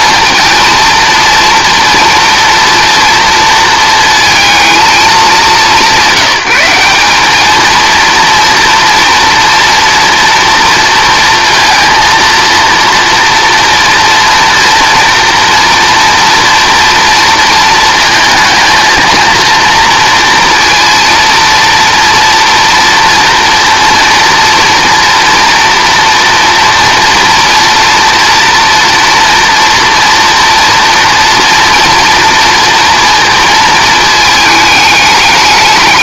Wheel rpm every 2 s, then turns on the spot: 230, 230, 220, 180, 230, 230, 230, 230, 230, 230, 230, 230, 230, 230, 230, 230, 230, 210.
none